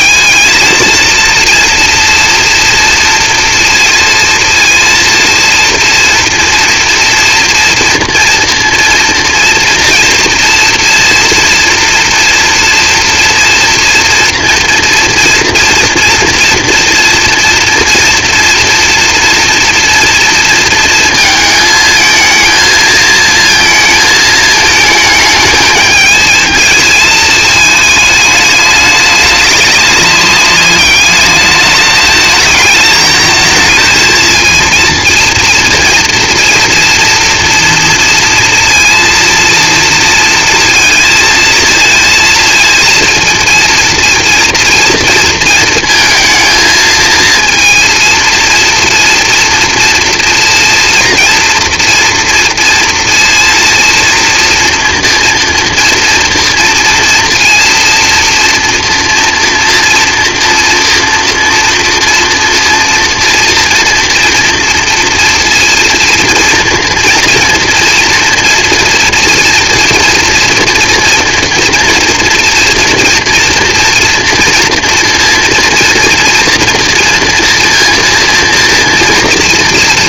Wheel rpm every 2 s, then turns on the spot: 230, 230, 230, 230, 230, 230, 230, 230, 230, 230, 230, 230, 220, 220, 210, 200, 220, 230, 230, 230, 230, 230, 230, 230, 230, 230, 230, 230, 230, 230, 230, 230, 230, 230, 230, 230, 230, 230, 230, 230.
none